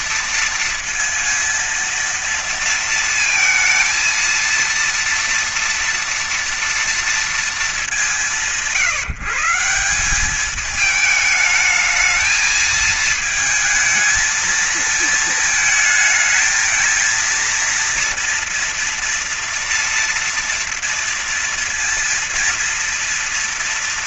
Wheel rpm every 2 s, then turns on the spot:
230, 230, 230, 230, 160, 190, 220, 220, 220, 230, 230, 230.
none